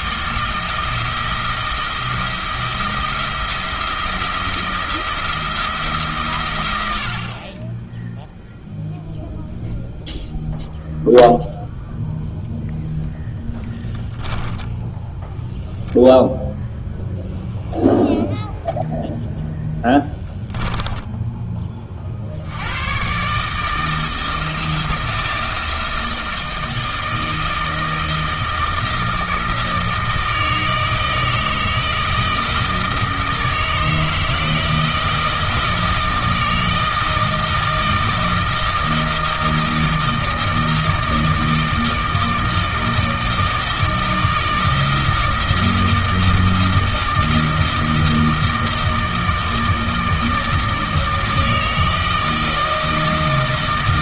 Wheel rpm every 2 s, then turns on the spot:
170, 170, 170, 90, 0, 0, 0, 10, 0, 0, 20, 100, 170, 160, 160, 160, 160, 160, 160, 160, 160, 160, 160, 160, 160, 160, 160.
14-16 20-22